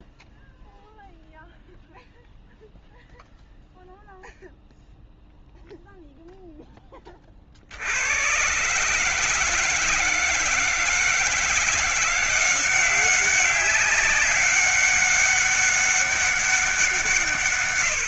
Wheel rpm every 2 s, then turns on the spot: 0, 0, 0, 10, 130, 170, 190, 200, 180.
none